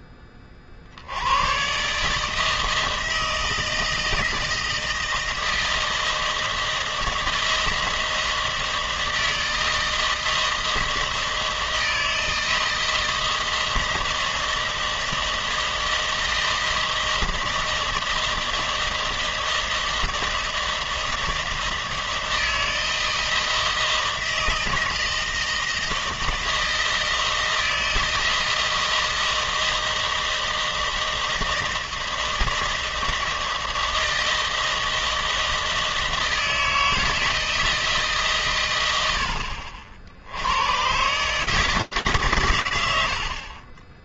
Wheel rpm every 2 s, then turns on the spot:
20, 150, 160, 160, 160, 160, 160, 160, 160, 160, 160, 160, 160, 160, 160, 160, 160, 160, 160, 140, 80, 130.
none